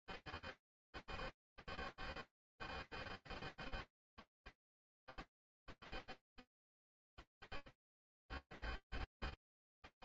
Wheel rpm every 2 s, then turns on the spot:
0, 0, 0, 0, 0.
none